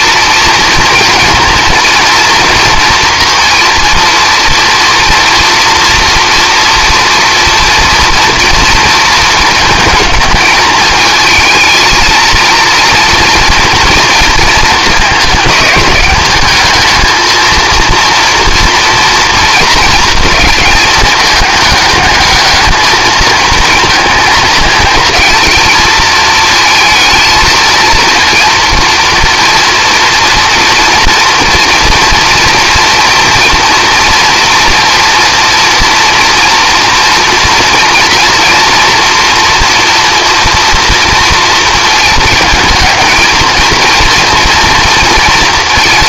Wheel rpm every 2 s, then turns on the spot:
230, 230, 230, 230, 230, 220, 230, 220, 210, 230, 220, 210, 220, 220, 230, 230, 230, 230, 230, 230, 230, 220, 230.
none